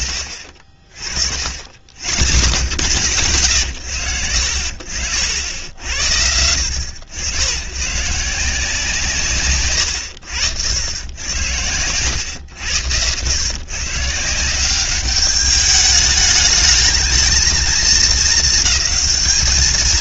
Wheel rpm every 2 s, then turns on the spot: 50, 80, 70, 90, 160, 100, 110, 200, 220, 220.
none